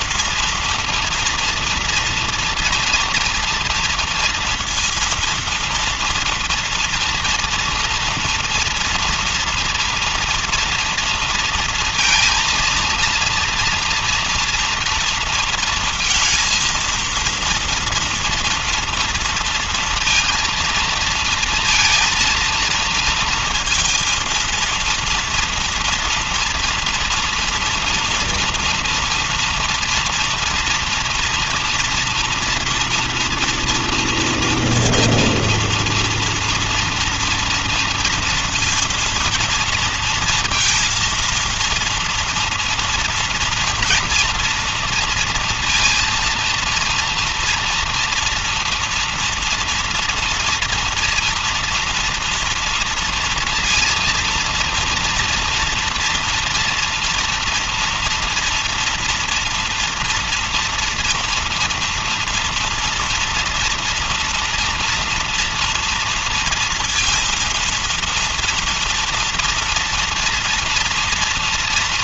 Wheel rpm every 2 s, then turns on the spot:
230, 230, 230, 230, 230, 230, 230, 230, 230, 240, 230, 230, 230, 230, 240, 240, 230, 230, 230, 230, 230, 230, 240, 230, 230, 230, 230, 230, 230, 240, 230, 230, 230, 230, 230, 230.
none